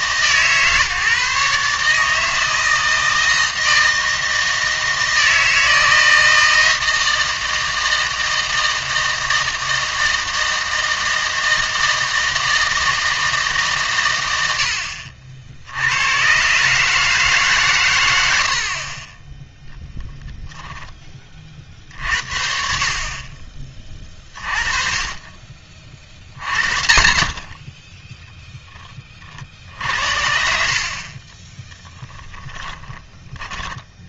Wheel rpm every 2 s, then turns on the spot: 140, 160, 160, 160, 160, 160, 160, 80, 130, 60, 10, 50, 30, 40, 10, 50, 10.
none